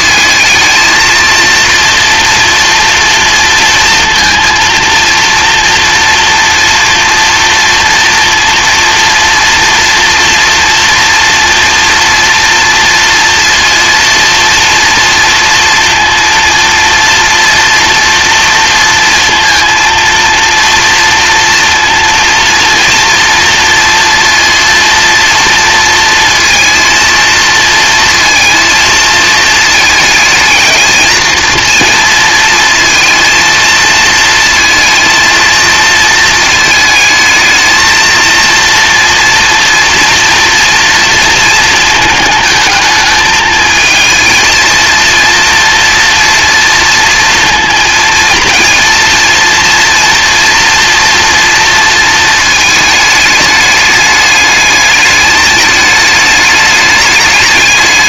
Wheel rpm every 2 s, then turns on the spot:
230, 230, 230, 230, 230, 240, 230, 230, 230, 230, 230, 230, 230, 230, 230, 220, 230, 230, 220, 230, 230, 220, 230, 230, 230, 230, 220, 210, 210.
none